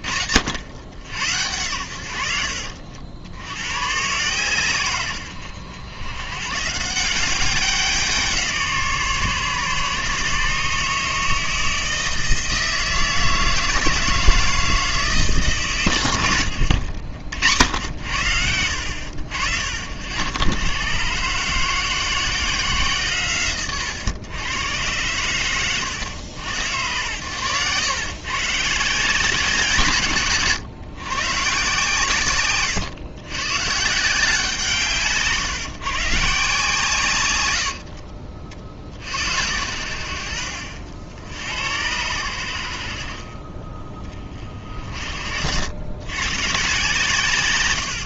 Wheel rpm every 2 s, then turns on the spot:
80, 70, 130, 140, 170, 150, 160, 160, 100, 80, 110, 170, 120, 110, 140, 130, 130, 160, 140, 50, 70, 80, 40, 130.
none